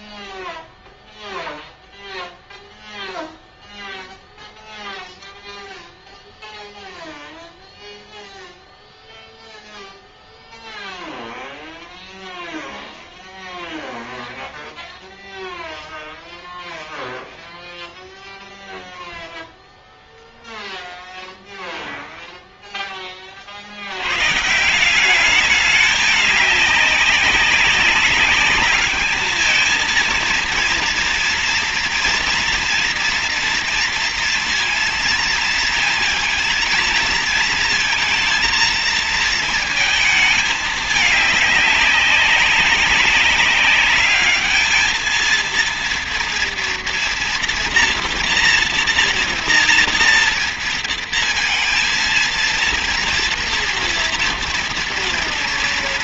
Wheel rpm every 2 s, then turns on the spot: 0, 0, 0, 0, 0, 0, 0, 0, 0, 0, 0, 0, 140, 200, 200, 230, 230, 230, 230, 230, 220, 200, 220, 230, 240, 230, 230, 240.
none